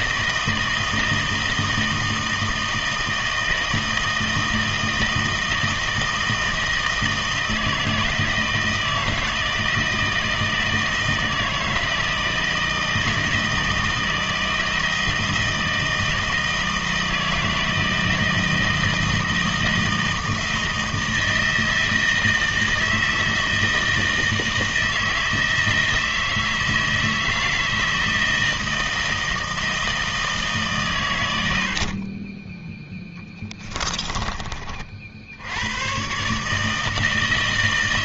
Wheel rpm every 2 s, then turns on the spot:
160, 160, 160, 160, 160, 160, 160, 160, 160, 160, 160, 160, 160, 160, 160, 150, 20, 40, 150.
none